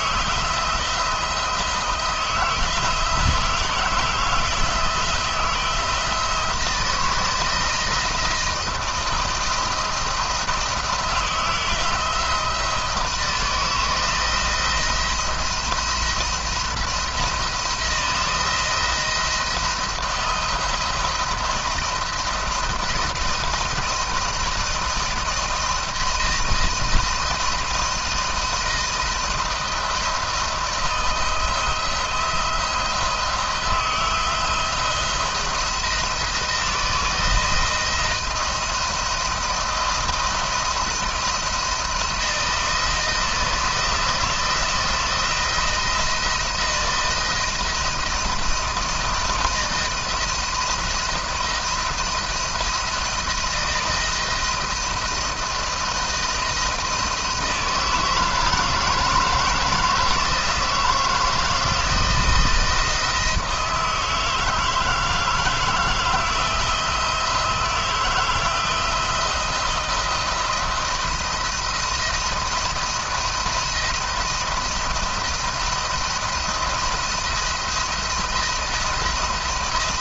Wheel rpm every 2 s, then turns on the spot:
160, 170, 160, 170, 160, 160, 160, 170, 170, 170, 170, 170, 170, 160, 160, 170, 170, 170, 160, 170, 170, 170, 170, 170, 160, 170, 160, 160, 160, 160, 160, 160, 160, 170, 170, 170, 160, 170, 170, 170.
none